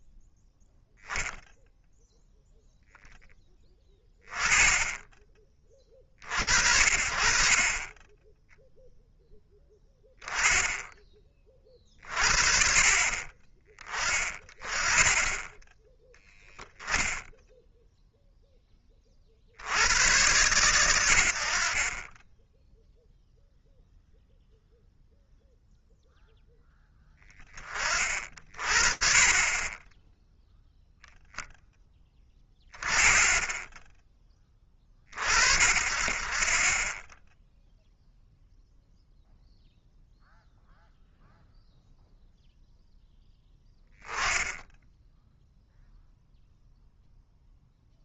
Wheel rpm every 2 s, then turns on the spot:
0, 0, 20, 60, 0, 10, 60, 30, 0, 20, 110, 10, 0, 10, 50, 0, 20, 30, 20, 0, 0, 0, 10, 0.
32-34